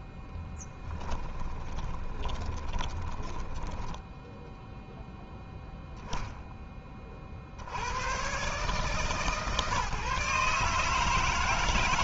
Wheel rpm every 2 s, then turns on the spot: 0, 20, 0, 10, 120, 140.
2-4